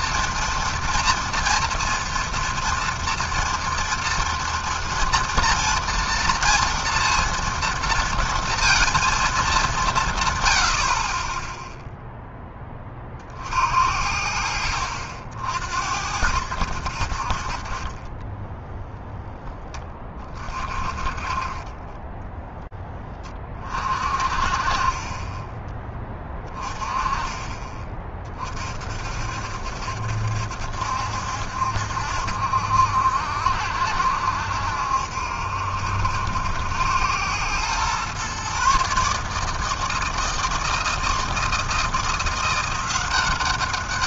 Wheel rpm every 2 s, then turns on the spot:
230, 230, 240, 230, 230, 100, 10, 70, 80, 10, 40, 10, 40, 20, 40, 70, 70, 70, 90, 130, 160, 170.
18-20